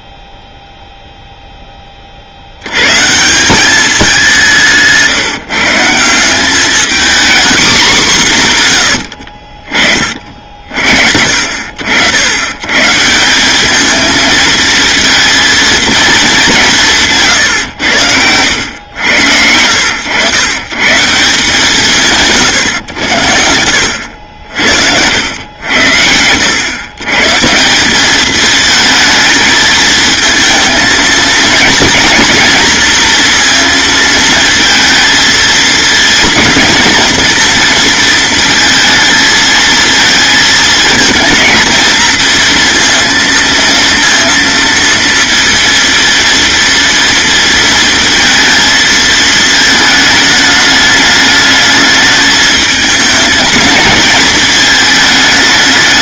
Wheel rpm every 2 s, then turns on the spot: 0, 130, 160, 240, 100, 70, 150, 230, 170, 100, 150, 100, 80, 120, 220, 220, 230, 230, 230, 220, 220, 230, 230, 230, 220, 210, 220, 220.
none